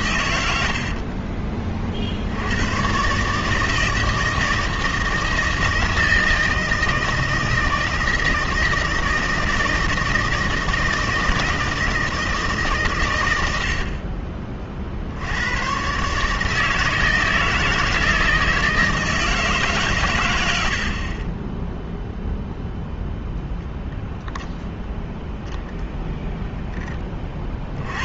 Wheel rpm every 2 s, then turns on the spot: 80, 100, 160, 160, 160, 160, 140, 40, 160, 160, 90, 0, 0, 0.
none